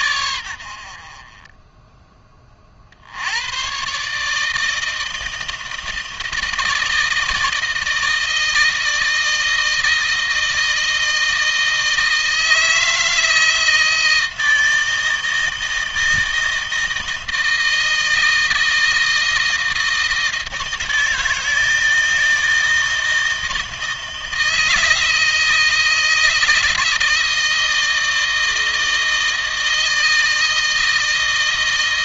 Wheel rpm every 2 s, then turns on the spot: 50, 60, 160, 160, 160, 160, 160, 160, 160, 160, 160, 160, 160, 160, 160, 160.
none